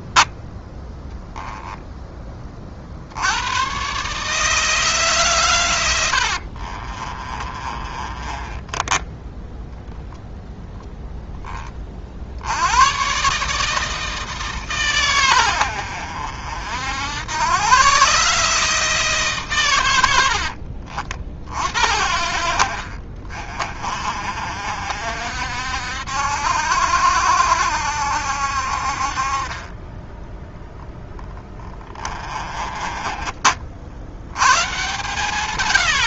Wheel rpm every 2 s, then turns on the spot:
10, 50, 150, 40, 30, 0, 110, 130, 70, 150, 60, 60, 70, 70, 50, 10, 30, 120.
6-10 20-22 32-34